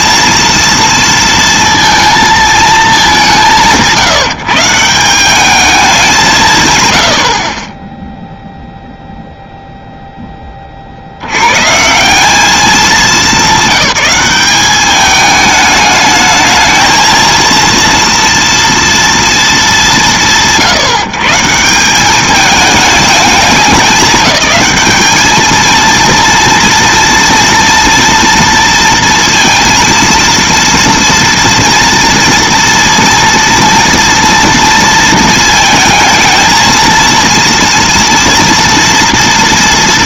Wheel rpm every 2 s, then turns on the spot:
230, 230, 140, 210, 0, 0, 160, 200, 210, 230, 160, 190, 210, 230, 230, 230, 230, 230, 220, 230.
none